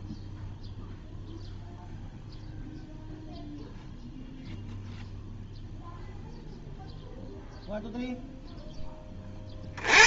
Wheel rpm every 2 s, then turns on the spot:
0, 0, 0, 0, 0.
none